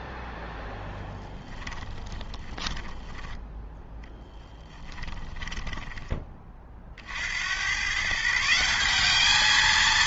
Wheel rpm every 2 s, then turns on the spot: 10, 10, 20, 40, 190.
0-6